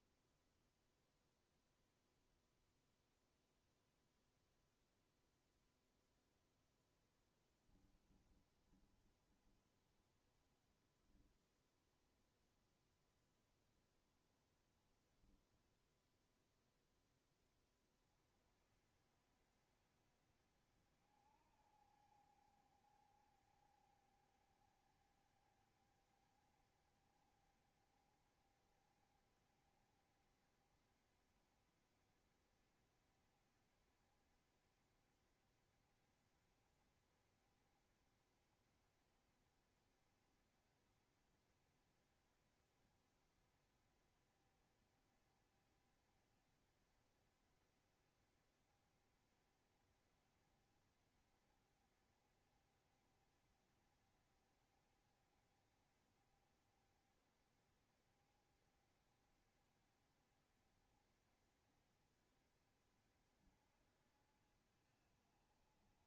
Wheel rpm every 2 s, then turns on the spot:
0, 0, 0, 0, 10, 10, 20, 10, 10, 60, 60, 70, 70, 70, 70, 70, 70, 70, 70, 70, 70, 60, 70, 70, 70, 60, 70, 60, 70, 70, 70, 70, 60.
8-14